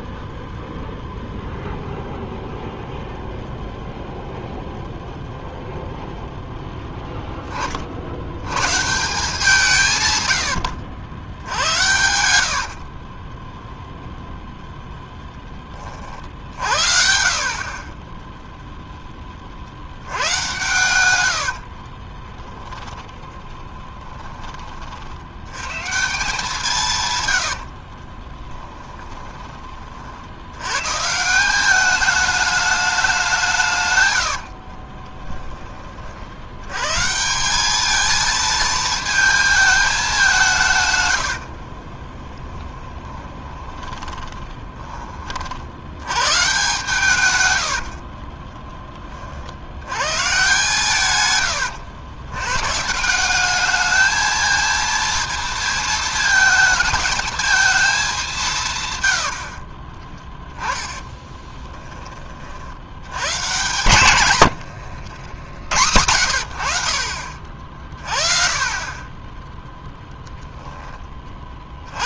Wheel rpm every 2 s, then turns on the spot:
0, 0, 0, 10, 140, 80, 50, 0, 50, 0, 100, 10, 50, 150, 10, 110, 210, 40, 120, 230, 130, 20, 20, 140, 20, 140, 160, 230, 220, 120, 10, 90, 80, 70, 20, 10.
12-14 22-24 26-30 34-36 42-44 60-62 64-66